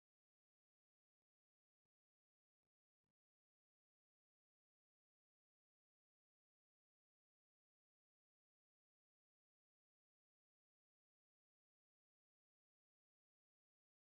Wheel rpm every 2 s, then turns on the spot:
0, 0, 0, 0, 0, 0, 0.
none